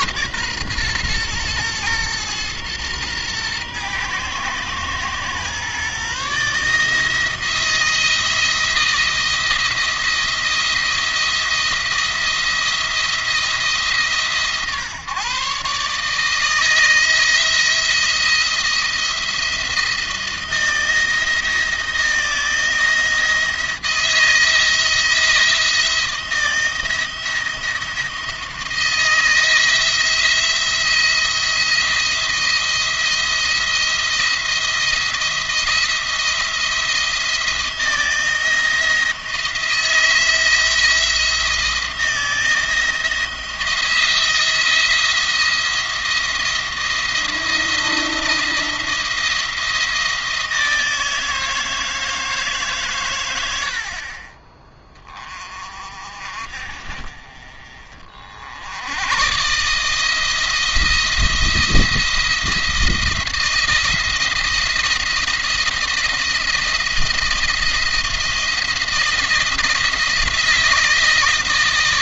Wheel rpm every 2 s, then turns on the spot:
130, 120, 120, 150, 170, 170, 170, 140, 160, 170, 170, 170, 170, 170, 170, 170, 170, 170, 170, 170, 160, 160, 170, 160, 170, 160, 140, 20, 40, 80, 170, 170, 170, 170, 170, 160.
none